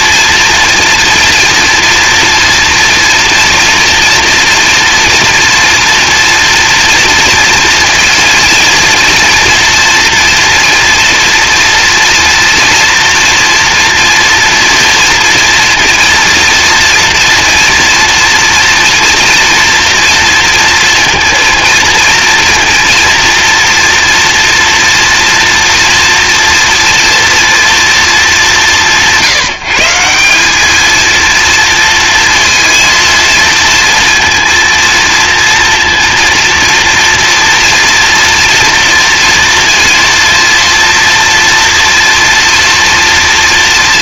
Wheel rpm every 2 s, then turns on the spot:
230, 230, 230, 230, 230, 230, 240, 230, 230, 230, 230, 230, 230, 230, 190, 210, 230, 230, 230, 230, 230, 230.
none